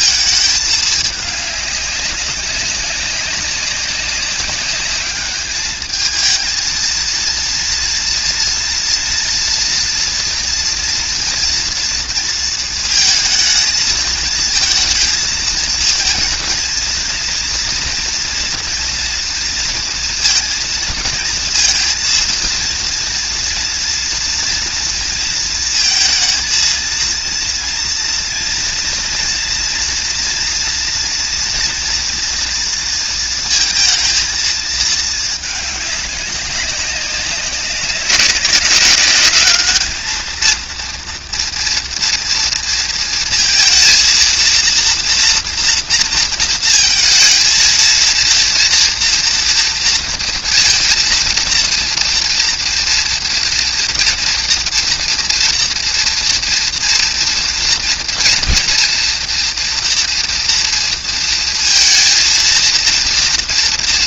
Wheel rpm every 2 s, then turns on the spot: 210, 190, 200, 220, 230, 230, 230, 230, 230, 240, 230, 230, 230, 230, 230, 240, 230, 220, 190, 200, 230, 230, 230, 230, 230, 230, 230, 230, 230, 230, 230, 230.
none